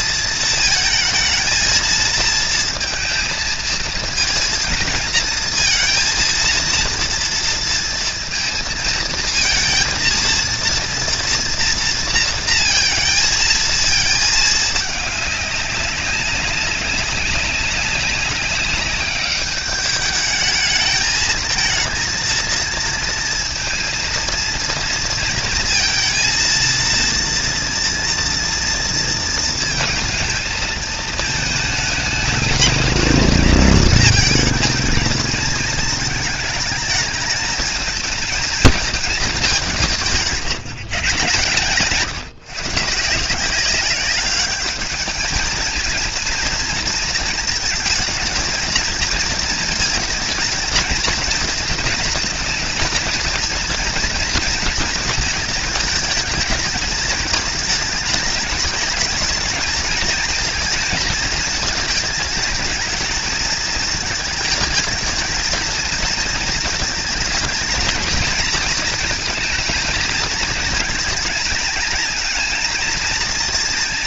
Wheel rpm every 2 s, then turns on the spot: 220, 230, 230, 230, 230, 230, 230, 220, 190, 200, 210, 230, 230, 230, 230, 220, 220, 220, 220, 230, 170, 160, 200, 230, 230, 230, 230, 240, 220, 210, 230, 220, 220, 230, 230, 220, 230.
none